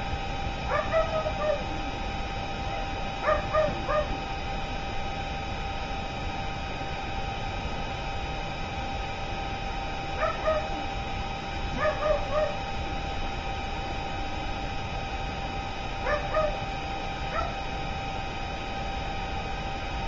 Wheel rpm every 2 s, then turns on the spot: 0, 0, 0, 0, 0, 0, 0, 0, 0, 0.
none